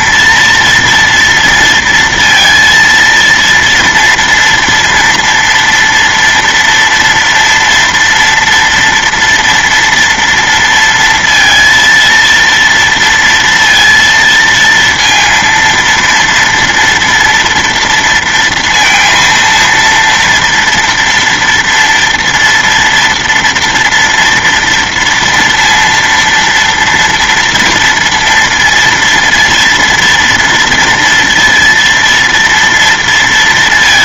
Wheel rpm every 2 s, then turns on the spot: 230, 230, 230, 230, 230, 230, 230, 230, 230, 230, 230, 230, 230, 230, 230, 230, 230.
none